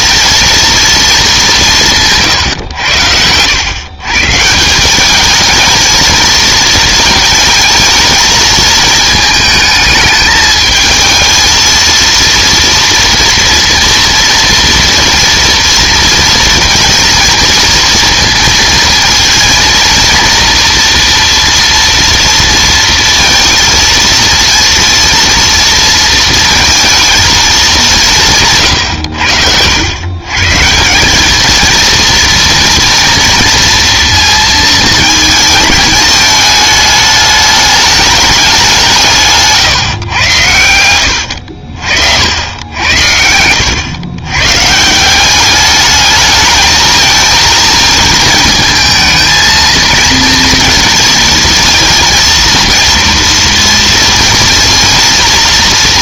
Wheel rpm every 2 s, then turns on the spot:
230, 110, 180, 230, 220, 220, 240, 230, 230, 230, 230, 230, 230, 230, 150, 160, 240, 220, 210, 190, 90, 80, 140, 220, 220, 230, 230, 230.
42-44